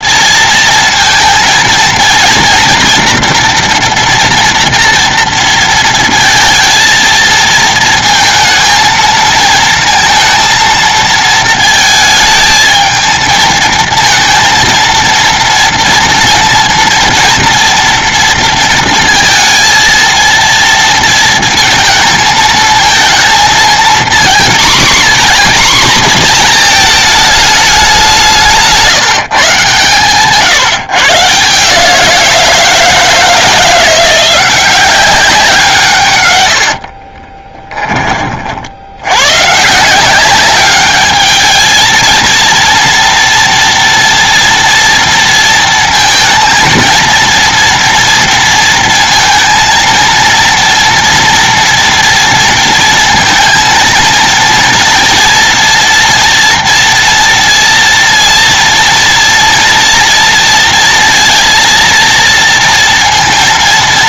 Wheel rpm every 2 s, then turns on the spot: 230, 230, 230, 230, 230, 230, 220, 230, 230, 230, 230, 220, 240, 230, 170, 150, 170, 180, 70, 70, 200, 230, 230, 230, 230, 230, 220, 230, 240, 230, 230, 230.
36-38